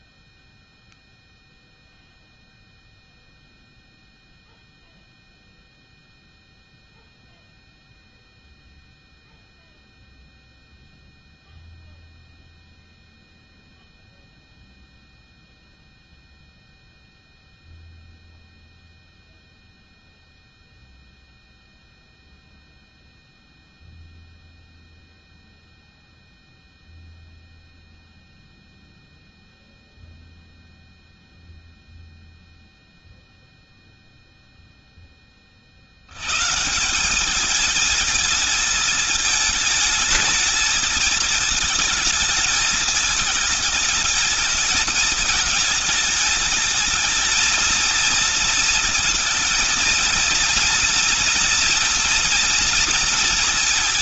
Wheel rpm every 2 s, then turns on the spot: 0, 0, 0, 0, 0, 0, 0, 0, 0, 0, 0, 0, 0, 0, 0, 0, 0, 0, 140, 220, 220, 220, 220, 220, 230, 230, 230.
none